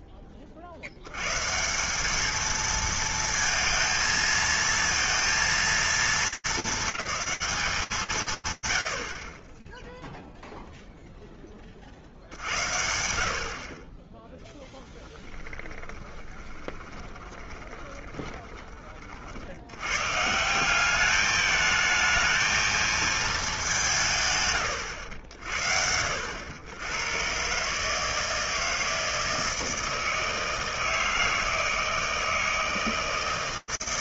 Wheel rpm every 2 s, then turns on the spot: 0, 170, 230, 220, 190, 20, 50, 40, 20, 20, 160, 220, 130, 80, 160, 160, 160.
16-18